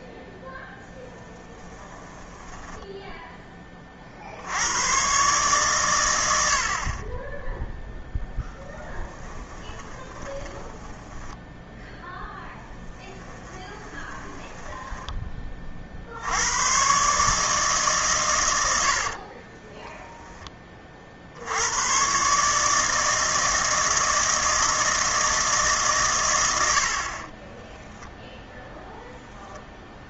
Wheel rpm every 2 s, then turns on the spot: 10, 40, 110, 0, 10, 0, 10, 40, 140, 10, 90, 160, 150, 20, 0.
0-2 8-10 12-14 18-20 26-28